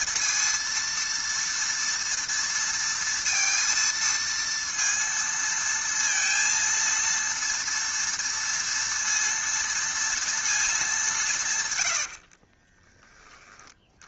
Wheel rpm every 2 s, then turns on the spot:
230, 230, 230, 230, 230, 220, 30.
12-14